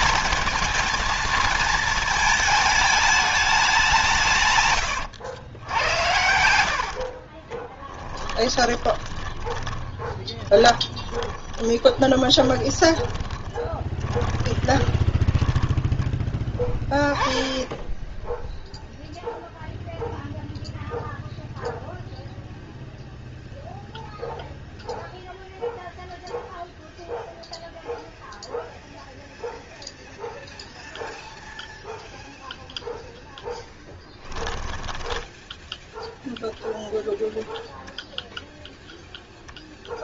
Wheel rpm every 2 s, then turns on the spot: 220, 220, 110, 70, 20, 20, 20, 20, 10, 0, 0, 0, 0, 0, 0, 0, 0, 10, 0, 0.
4-16 34-36